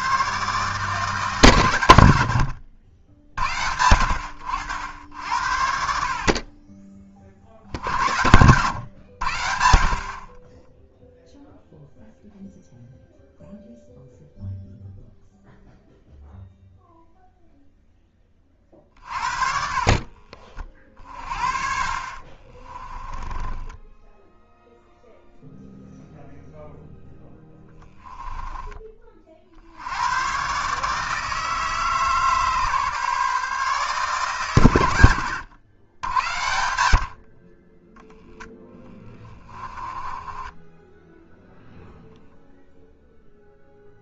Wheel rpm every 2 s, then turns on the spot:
140, 80, 80, 30, 100, 10, 0, 0, 0, 30, 40, 20, 0, 0, 10, 140, 150, 120, 90, 20, 10, 0.
10-12 18-20 22-24 38-40